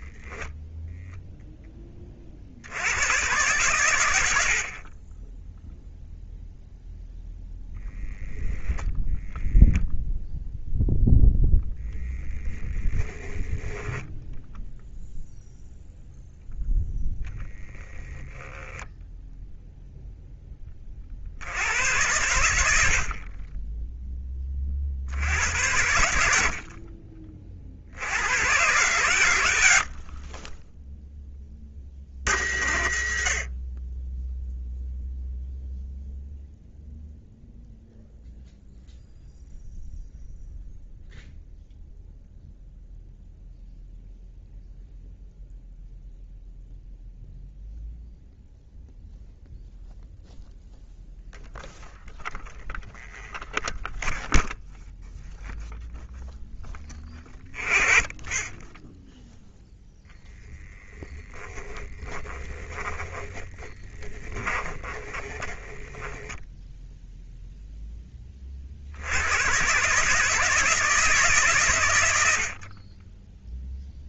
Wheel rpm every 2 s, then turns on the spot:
0, 90, 40, 0, 10, 0, 0, 0, 0, 10, 20, 70, 60, 40, 120, 10, 80, 0, 0, 0, 0, 0, 0, 0, 0, 0, 0, 0, 10, 10, 10, 10, 30, 10, 60, 160, 40.
62-66